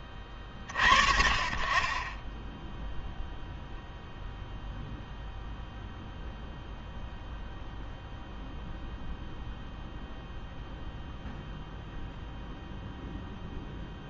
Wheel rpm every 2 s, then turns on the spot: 20, 20, 0, 0, 0, 0, 0.
none